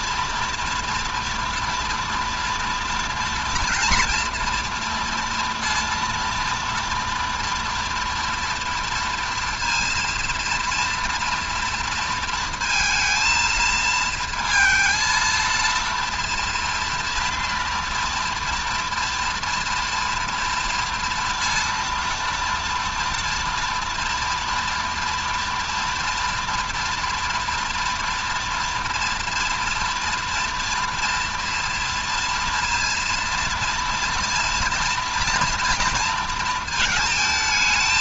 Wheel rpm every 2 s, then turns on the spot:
230, 230, 230, 230, 230, 230, 230, 230, 230, 230, 230, 230, 230, 230, 230, 230, 240, 230, 220.
none